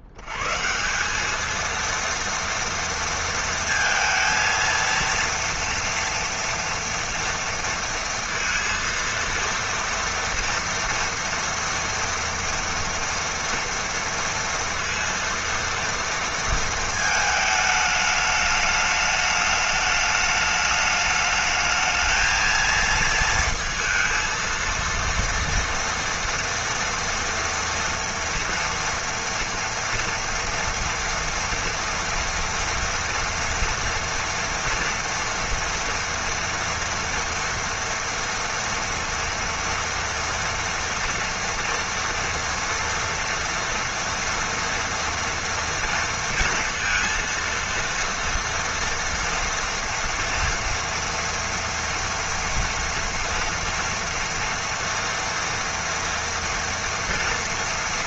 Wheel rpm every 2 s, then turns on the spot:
80, 230, 230, 240, 230, 230, 230, 230, 230, 210, 210, 220, 230, 230, 230, 230, 230, 240, 230, 230, 230, 230, 230, 230, 230, 230, 230, 230, 230.
none